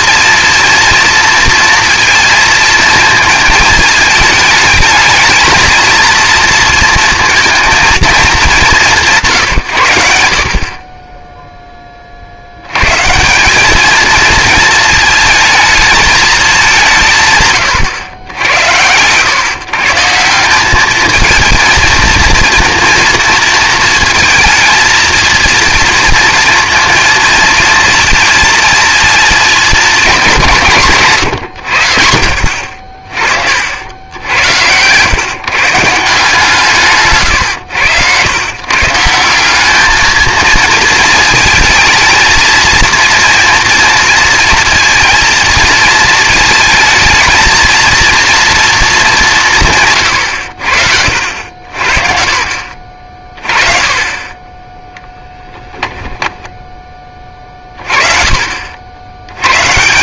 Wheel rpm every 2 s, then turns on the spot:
230, 230, 220, 230, 180, 30, 90, 220, 200, 100, 200, 230, 230, 230, 230, 170, 60, 100, 150, 140, 230, 230, 230, 220, 230, 80, 40, 10, 10, 60.
none